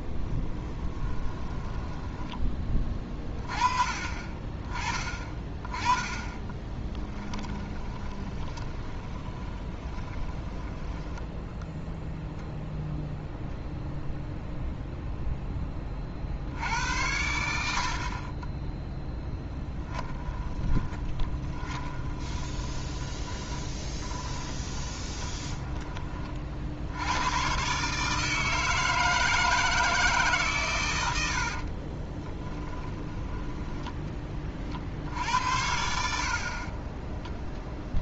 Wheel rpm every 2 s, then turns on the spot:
20, 20, 30, 20, 20, 10, 0, 0, 80, 10, 20, 20, 20, 60, 160, 130, 20, 40, 40.
0-2 6-12 20-26 32-34